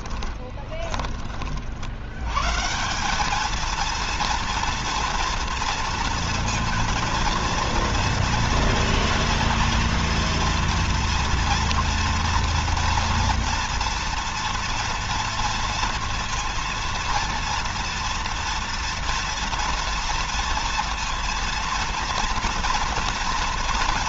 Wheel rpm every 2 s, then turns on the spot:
20, 160, 230, 230, 230, 230, 240, 240, 230, 230, 230, 230.
0-2